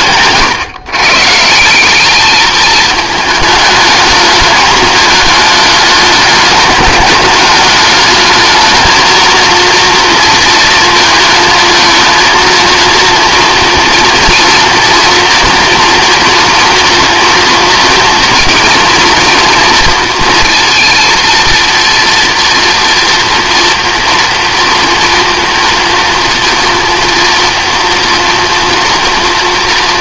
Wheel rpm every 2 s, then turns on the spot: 130, 210, 220, 200, 220, 230, 230, 230, 240, 230, 230, 240, 230, 230, 230.
none